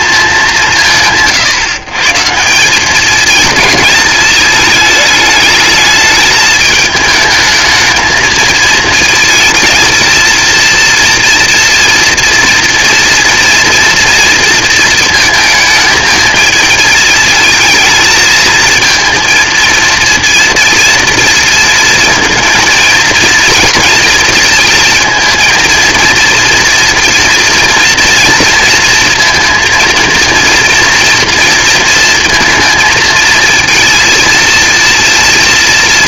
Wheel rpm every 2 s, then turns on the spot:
190, 170, 220, 210, 230, 230, 230, 230, 220, 230, 230, 230, 230, 240, 230, 230, 230, 230.
none